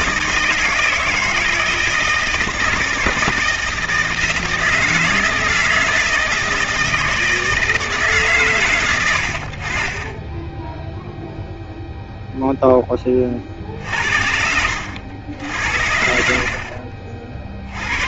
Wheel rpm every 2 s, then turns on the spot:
160, 160, 160, 160, 110, 10, 0, 80, 50.
16-18